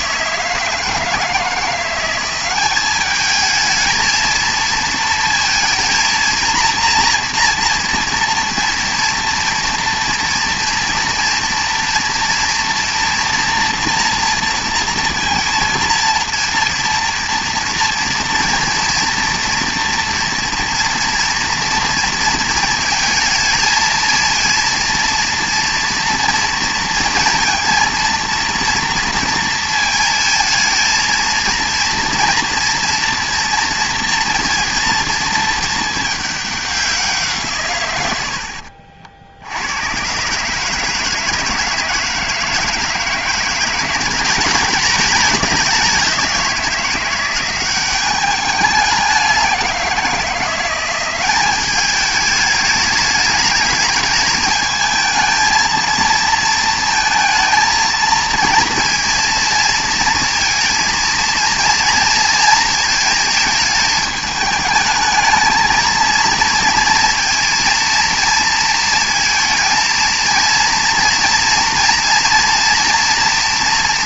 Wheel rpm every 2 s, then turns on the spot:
160, 190, 230, 230, 230, 230, 240, 230, 230, 230, 230, 230, 230, 230, 230, 220, 230, 230, 200, 70, 150, 160, 200, 180, 200, 180, 210, 220, 230, 230, 220, 230, 220, 230, 230, 230, 240.
none